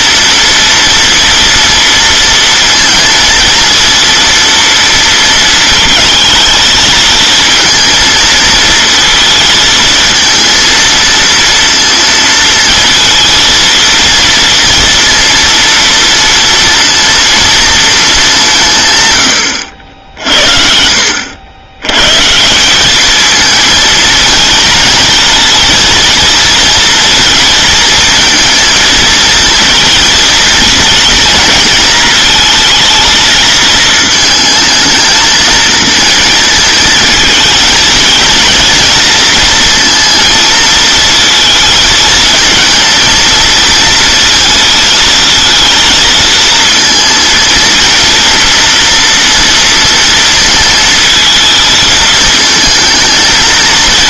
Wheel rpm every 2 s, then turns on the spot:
230, 230, 230, 220, 230, 230, 230, 230, 230, 170, 60, 180, 230, 230, 230, 230, 220, 220, 230, 230, 220, 230, 220, 230, 230, 220, 220.
none